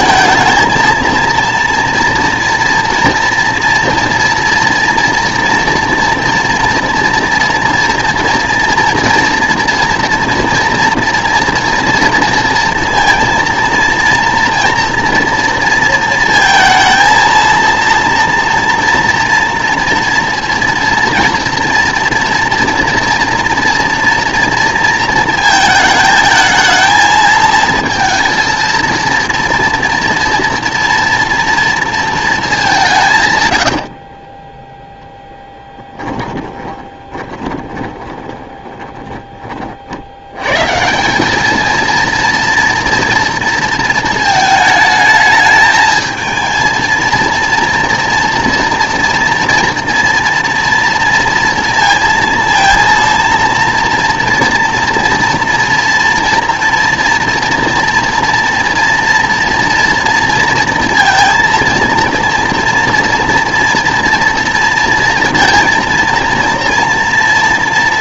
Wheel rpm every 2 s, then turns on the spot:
220, 230, 230, 230, 230, 230, 230, 230, 230, 230, 230, 240, 230, 220, 230, 240, 180, 10, 10, 20, 150, 230, 220, 230, 230, 230, 230, 230, 230, 230, 230, 230, 230, 230.
36-40